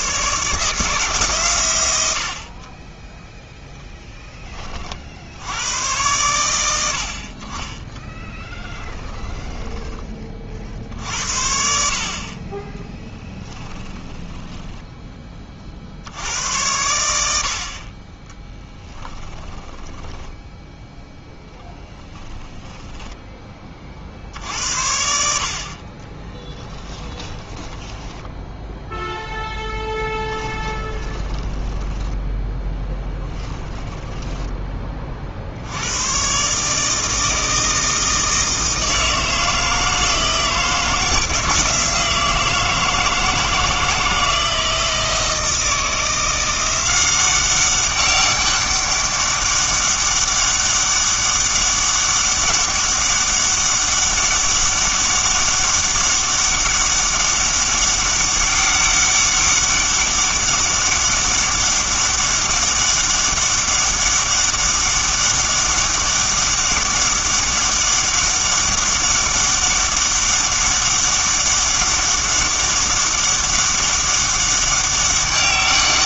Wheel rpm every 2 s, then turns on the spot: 160, 30, 30, 80, 10, 50, 10, 10, 100, 10, 0, 10, 70, 10, 0, 20, 10, 20, 150, 160, 170, 160, 160, 180, 200, 200, 200, 200, 200, 200, 200, 200, 200, 200, 200, 200, 200, 200.
8-10 12-16 18-20 22-24 26-28 30-34